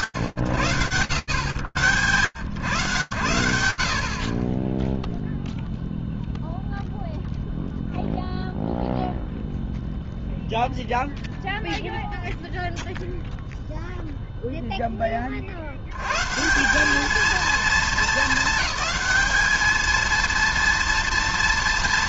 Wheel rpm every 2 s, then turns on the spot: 100, 20, 0, 0, 0, 0, 0, 120, 210, 230, 230.
none